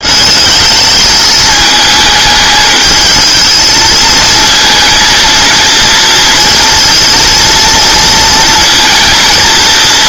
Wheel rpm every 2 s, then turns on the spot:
220, 210, 230, 230, 230.
none